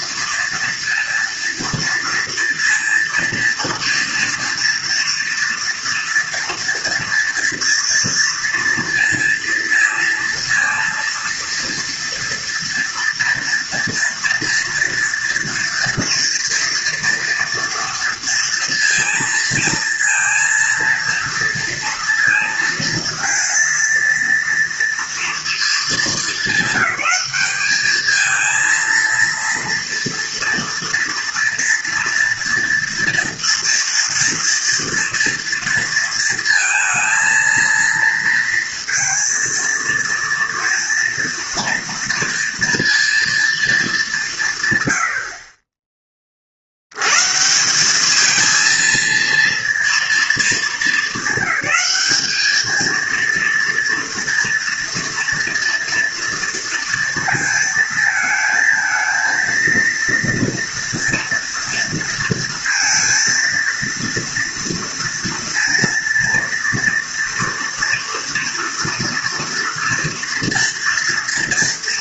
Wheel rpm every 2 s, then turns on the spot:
240, 230, 240, 230, 230, 230, 230, 230, 230, 230, 230, 230, 230, 220, 220, 230, 230, 230, 230, 230, 230, 230, 140, 60, 220, 230, 220, 230, 230, 220, 230, 230, 230, 240, 230, 230.
none